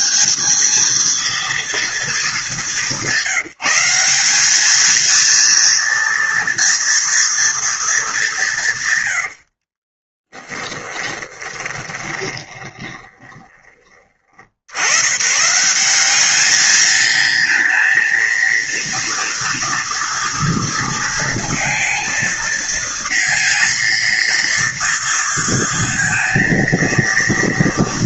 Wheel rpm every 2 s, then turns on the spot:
220, 190, 220, 230, 140, 20, 20, 100, 220, 230, 230, 230, 230, 230.
10-14